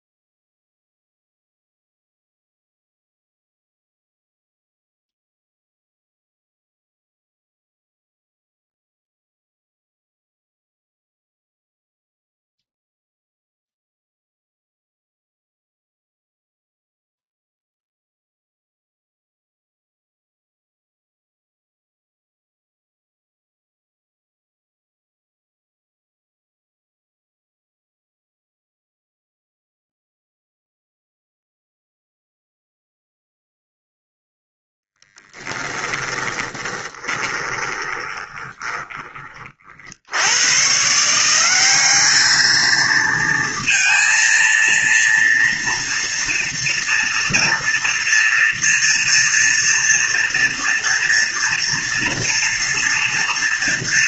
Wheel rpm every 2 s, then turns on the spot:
0, 0, 0, 0, 0, 0, 0, 0, 0, 0, 0, 0, 0, 0, 0, 0, 0, 0, 20, 20, 150, 220, 230, 230, 230, 230, 230.
36-40